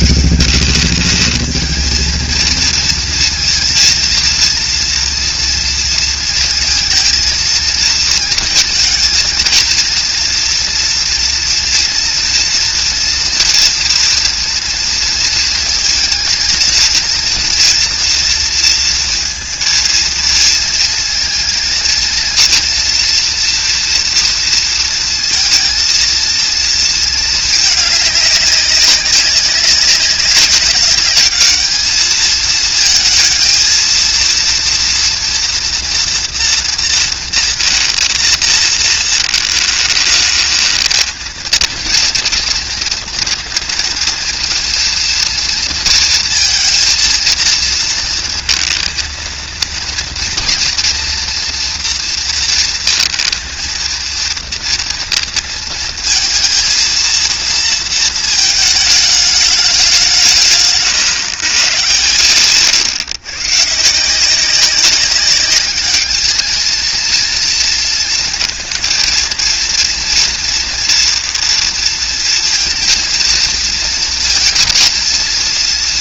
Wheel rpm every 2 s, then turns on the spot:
200, 230, 230, 230, 220, 230, 230, 230, 230, 230, 230, 240, 230, 230, 200, 200, 220, 230, 230, 220, 220, 230, 230, 230, 230, 230, 230, 230, 230, 220, 130, 120, 190, 220, 230, 240, 230, 230.
none